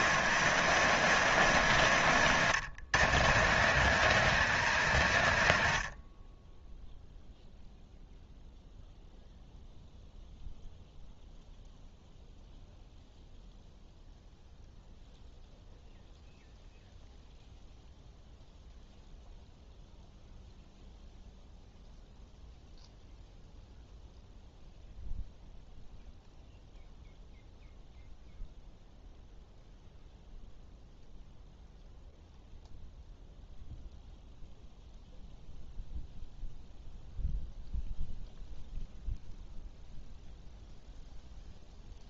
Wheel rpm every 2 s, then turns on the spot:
120, 100, 100, 0, 0, 0, 0, 0, 0, 0, 0, 0, 0, 0, 0, 0, 0, 0, 0, 0, 0.
none